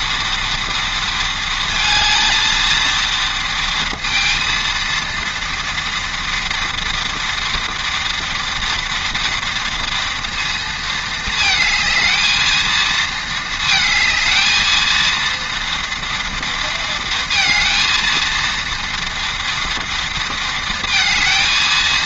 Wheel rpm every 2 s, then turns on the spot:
230, 230, 230, 230, 230, 220, 220, 230, 230, 230, 220.
none